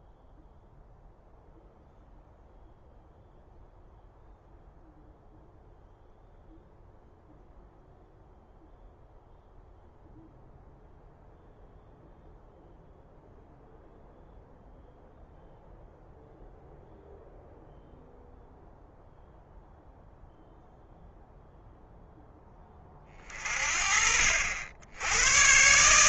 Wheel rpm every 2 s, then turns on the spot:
0, 0, 0, 0, 0, 0, 0, 0, 0, 0, 0, 20, 80.
none